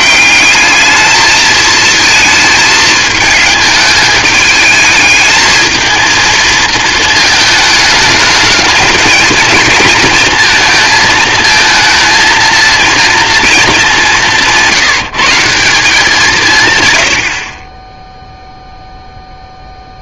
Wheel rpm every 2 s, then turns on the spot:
210, 220, 220, 220, 210, 220, 230, 170, 130, 0.
none